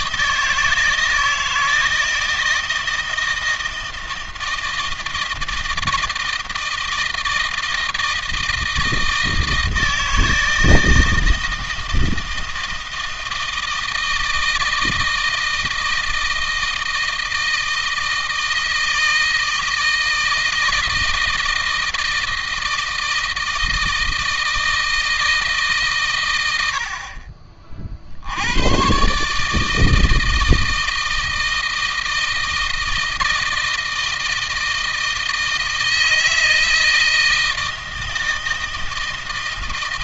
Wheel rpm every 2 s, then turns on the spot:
160, 160, 160, 160, 160, 160, 160, 160, 160, 160, 160, 160, 160, 60, 120, 160, 160, 160, 160, 160.
none